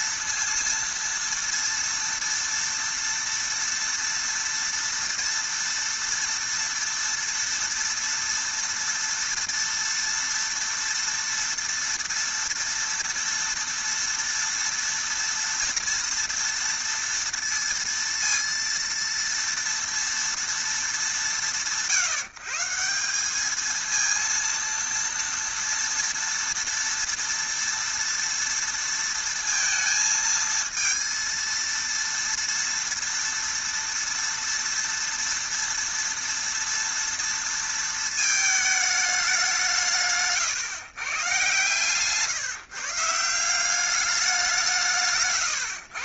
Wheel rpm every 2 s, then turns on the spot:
230, 230, 230, 230, 230, 230, 230, 230, 230, 230, 230, 160, 230, 230, 230, 220, 230, 230, 230, 220, 130, 140, 170.
none